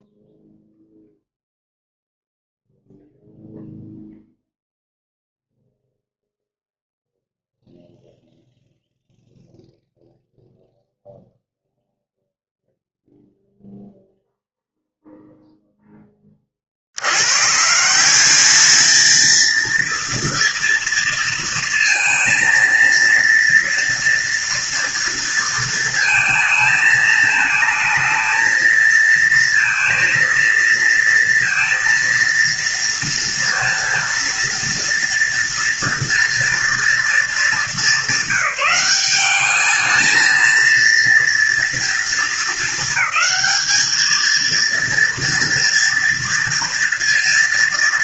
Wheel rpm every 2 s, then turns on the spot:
0, 0, 0, 0, 0, 0, 0, 0, 80, 220, 230, 230, 230, 220, 220, 230, 230, 230, 230, 190, 230, 220, 230, 230.
none